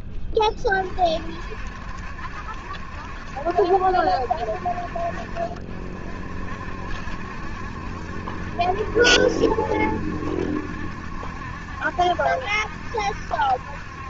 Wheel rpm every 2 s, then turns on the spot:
20, 70, 60, 70, 70, 70, 70.
none